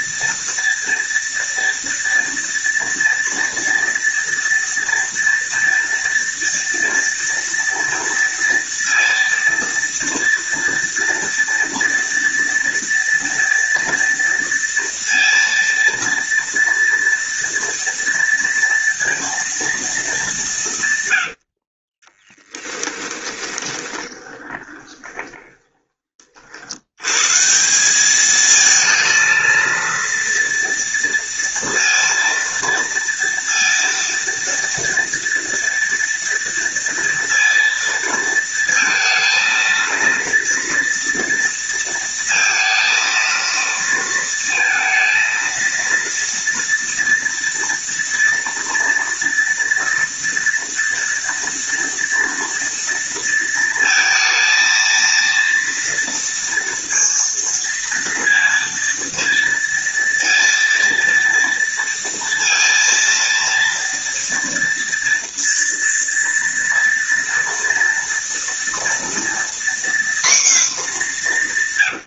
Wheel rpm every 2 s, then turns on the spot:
230, 230, 230, 230, 230, 230, 230, 230, 230, 230, 110, 20, 20, 120, 230, 230, 230, 230, 230, 230, 230, 230, 230, 230, 230, 230, 230, 230, 230, 230, 230, 230, 230, 230, 240, 210.
22-26